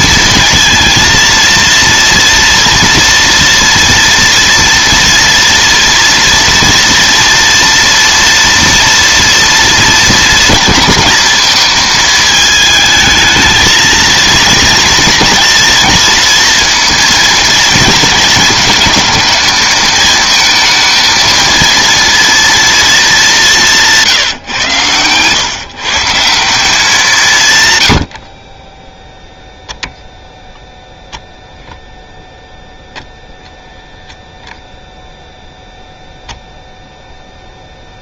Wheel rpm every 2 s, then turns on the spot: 230, 230, 230, 230, 230, 230, 220, 230, 230, 230, 220, 230, 120, 180, 20, 0, 0, 0, 0.
none